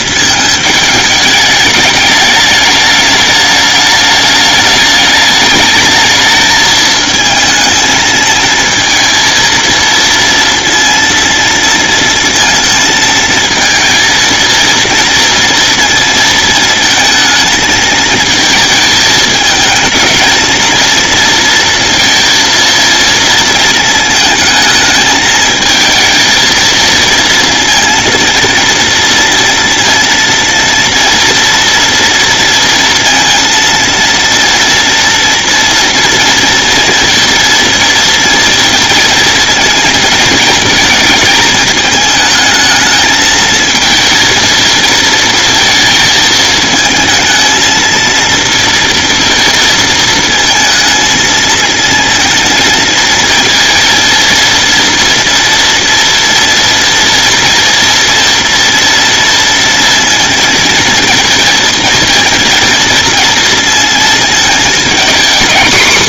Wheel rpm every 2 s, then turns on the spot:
220, 210, 210, 220, 230, 230, 230, 230, 220, 220, 230, 230, 220, 230, 230, 230, 230, 230, 230, 230, 220, 220, 220, 220, 230, 220, 230, 230, 230, 230, 230, 230, 220.
none